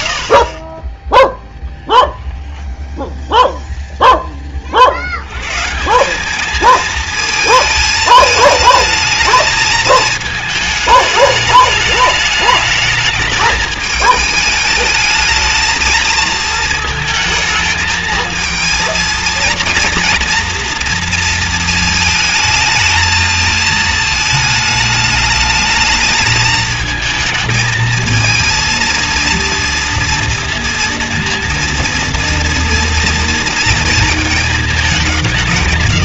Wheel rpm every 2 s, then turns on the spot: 0, 0, 90, 220, 220, 210, 220, 220, 220, 230, 230, 220, 220, 220, 230, 230, 230, 190.
none